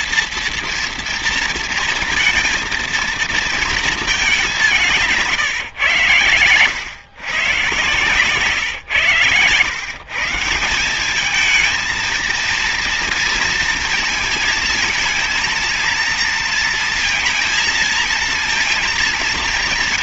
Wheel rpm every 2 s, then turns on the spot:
230, 230, 190, 120, 130, 170, 230, 220, 230, 220.
none